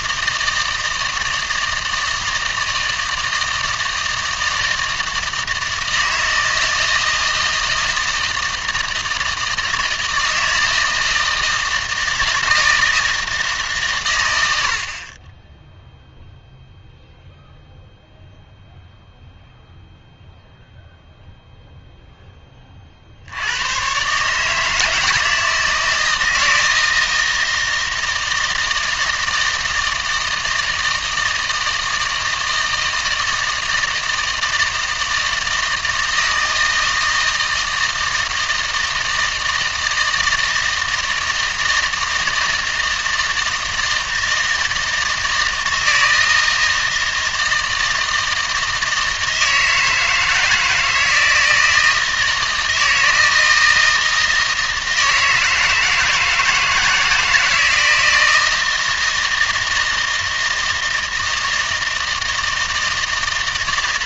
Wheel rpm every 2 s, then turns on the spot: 160, 160, 160, 160, 160, 160, 160, 80, 0, 0, 0, 30, 160, 160, 160, 160, 160, 160, 160, 160, 160, 160, 160, 160, 160, 160, 160, 160, 160, 160, 160, 160.
none